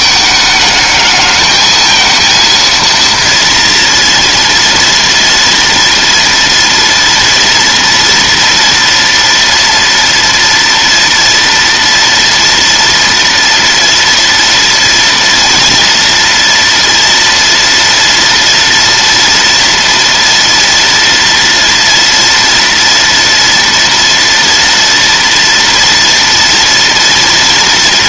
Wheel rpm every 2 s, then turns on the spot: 210, 230, 230, 230, 230, 230, 230, 240, 230, 230, 230, 230, 230, 230.
none